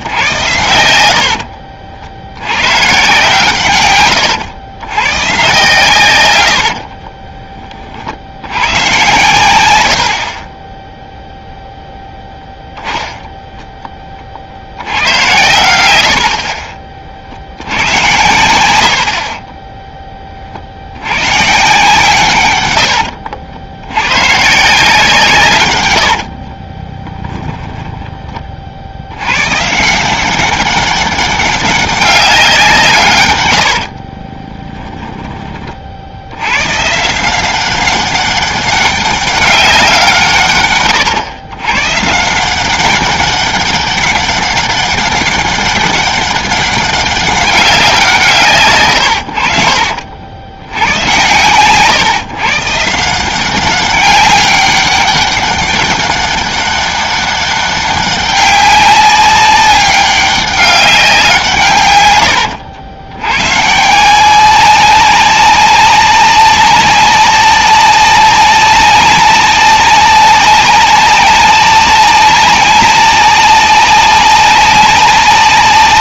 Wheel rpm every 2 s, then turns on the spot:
100, 110, 110, 60, 100, 20, 0, 70, 50, 80, 60, 100, 150, 30, 60, 190, 160, 10, 120, 200, 130, 190, 200, 200, 120, 90, 150, 200, 200, 200, 190, 80, 190, 200, 190, 190, 190, 190.
6-8 26-28 34-36